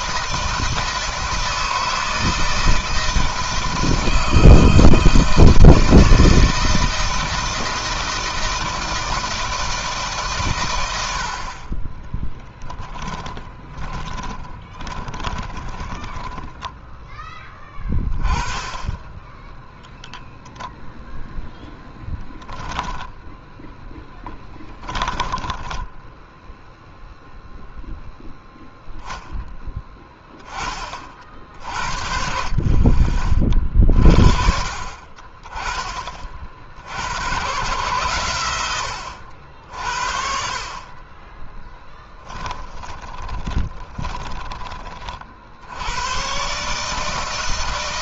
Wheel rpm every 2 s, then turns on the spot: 160, 160, 160, 160, 170, 120, 10, 20, 10, 20, 0, 10, 20, 0, 0, 20, 50, 50, 50, 100, 50, 10, 20, 140.
12-18 24-26 42-44